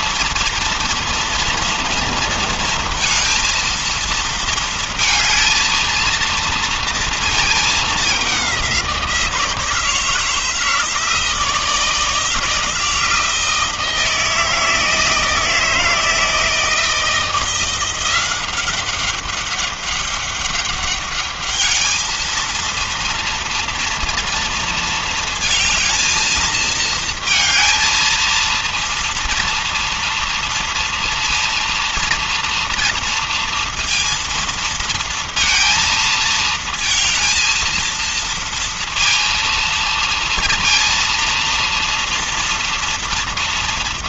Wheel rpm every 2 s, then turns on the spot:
230, 230, 230, 230, 200, 160, 160, 160, 160, 180, 200, 220, 230, 230, 230, 230, 230, 230, 230, 230, 230, 230.
none